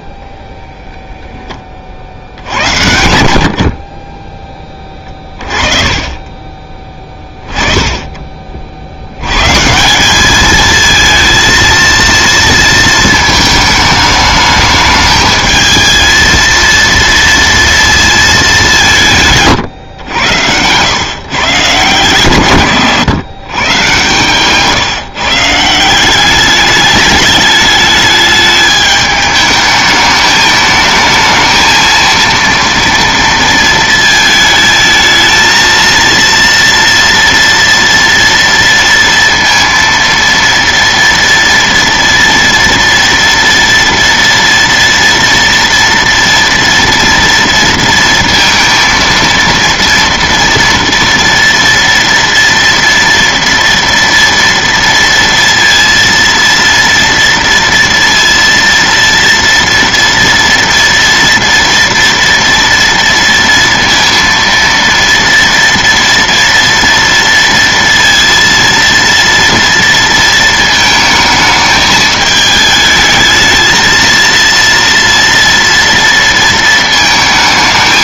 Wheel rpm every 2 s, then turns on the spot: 0, 80, 20, 30, 40, 220, 230, 210, 230, 200, 100, 150, 140, 200, 210, 220, 230, 220, 230, 230, 230, 230, 230, 230, 230, 230, 230, 230, 230, 230, 230, 230, 230, 230, 230, 220, 210, 230, 230.
4-8 24-26